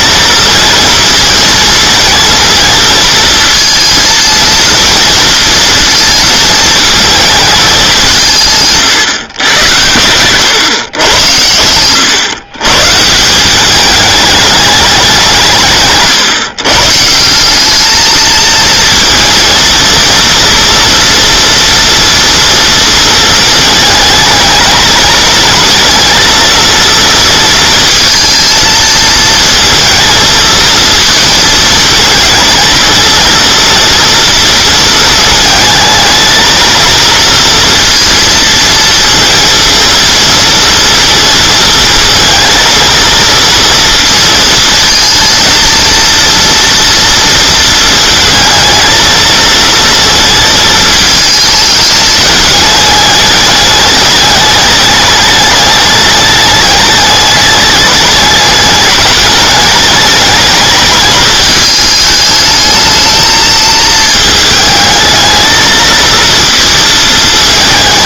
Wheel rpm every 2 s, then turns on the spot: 230, 230, 230, 220, 160, 120, 140, 200, 150, 230, 230, 230, 220, 230, 220, 220, 220, 230, 230, 230, 230, 230, 230, 230, 220, 220, 210, 210, 210, 210, 210, 220, 220, 230.
none